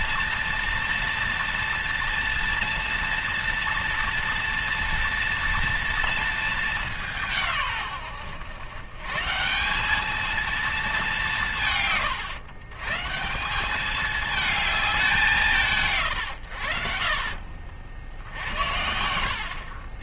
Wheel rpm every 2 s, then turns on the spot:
240, 230, 230, 200, 130, 210, 130, 200, 70, 80.
none